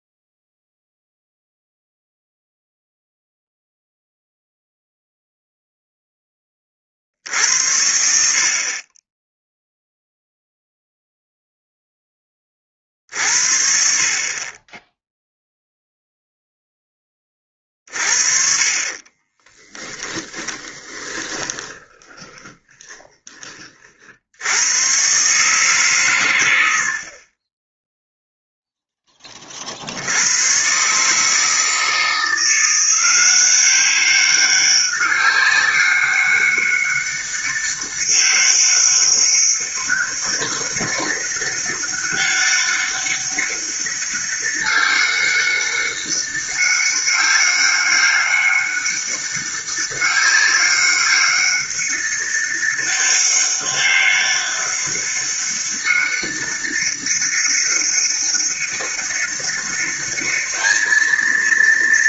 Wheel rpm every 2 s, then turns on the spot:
0, 0, 0, 40, 30, 0, 40, 20, 10, 40, 20, 10, 110, 80, 0, 120, 170, 200, 200, 200, 200, 200, 200, 200, 200, 200, 200, 200, 200, 200, 220.
18-24